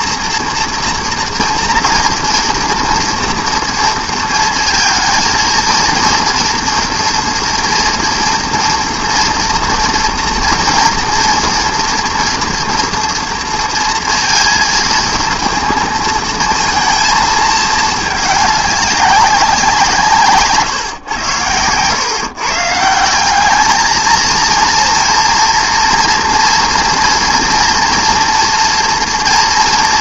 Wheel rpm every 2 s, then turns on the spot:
230, 240, 230, 230, 240, 240, 230, 230, 230, 200, 120, 170, 230, 230, 230.
none